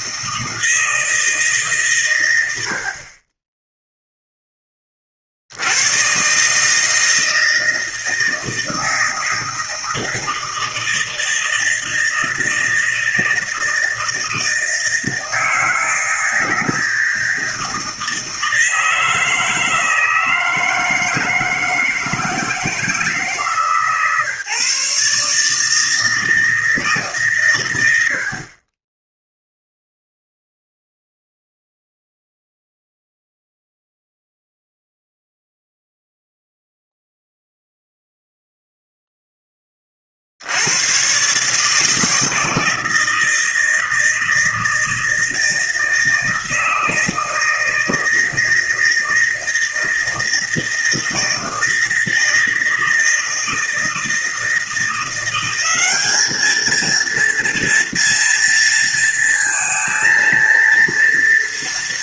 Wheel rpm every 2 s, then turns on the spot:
160, 80, 10, 140, 160, 160, 160, 160, 160, 160, 160, 160, 140, 160, 40, 0, 0, 0, 0, 0, 80, 160, 160, 160, 160, 160, 160, 160, 220, 230, 230.
none